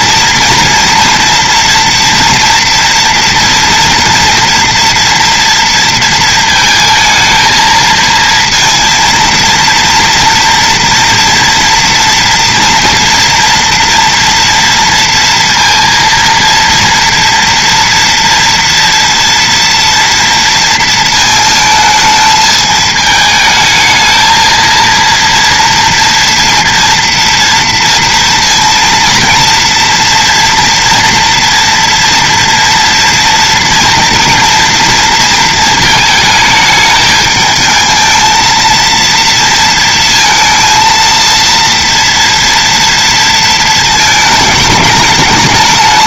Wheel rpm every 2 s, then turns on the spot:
230, 230, 230, 220, 230, 230, 230, 230, 230, 230, 230, 220, 230, 230, 230, 230, 230, 230, 220, 230, 230, 230, 210.
none